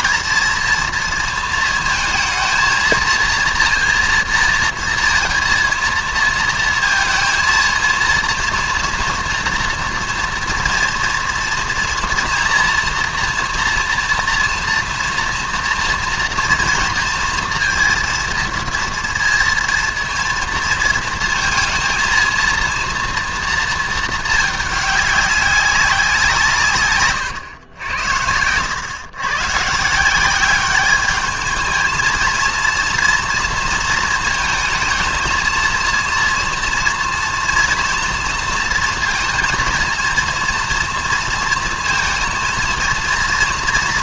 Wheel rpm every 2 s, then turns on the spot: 220, 220, 230, 230, 230, 230, 230, 230, 230, 230, 230, 230, 220, 180, 90, 160, 220, 220, 230, 230, 230, 230.
none